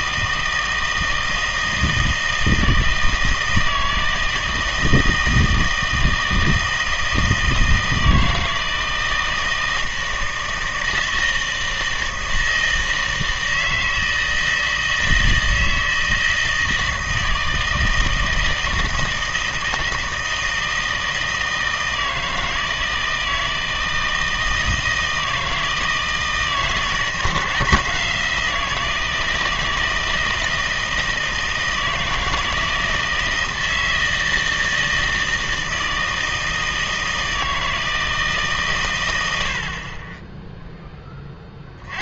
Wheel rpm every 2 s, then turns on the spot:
160, 160, 160, 160, 160, 160, 160, 160, 160, 160, 160, 160, 160, 160, 170, 160, 160, 160, 160, 130, 10.
none